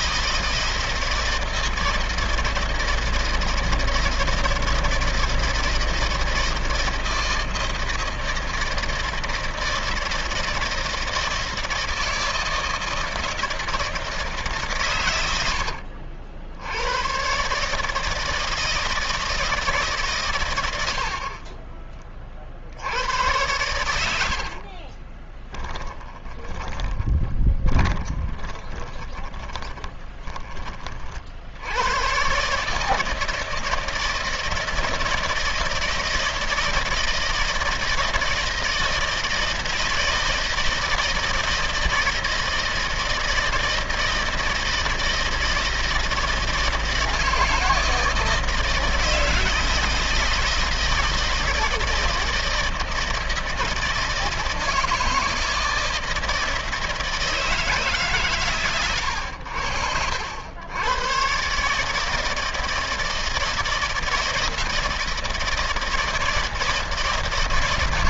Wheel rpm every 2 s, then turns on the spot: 170, 160, 160, 160, 160, 160, 160, 160, 80, 160, 120, 40, 70, 20, 10, 20, 130, 160, 160, 160, 160, 160, 160, 160, 160, 160, 160, 160, 160, 140, 90, 160, 160, 160.
24-30